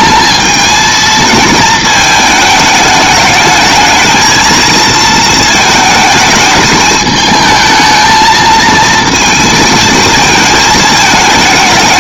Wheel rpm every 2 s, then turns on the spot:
220, 220, 220, 220, 230, 220.
none